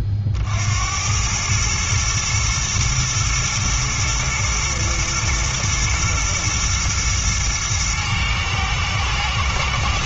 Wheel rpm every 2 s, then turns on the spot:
50, 110, 110, 120, 110.
none